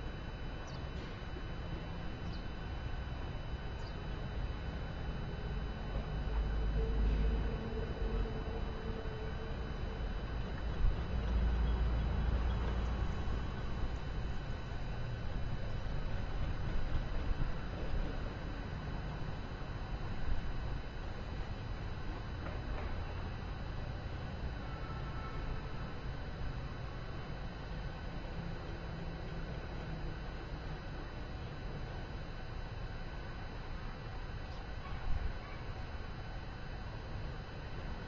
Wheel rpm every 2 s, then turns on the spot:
0, 0, 0, 0, 0, 0, 0, 0, 0, 0, 0, 0, 0, 0, 0, 0, 0, 0, 0.
none